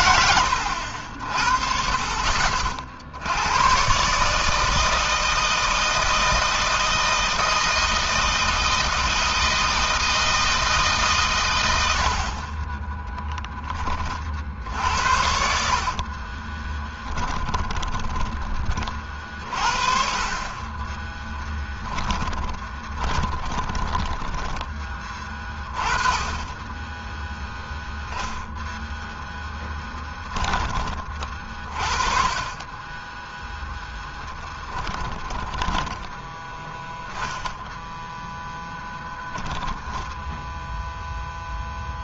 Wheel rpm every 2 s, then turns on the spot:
70, 60, 160, 160, 160, 140, 20, 60, 10, 30, 20, 20, 20, 10, 0, 30, 20, 10, 10, 0, 0.
12-14 16-18 20-24 34-36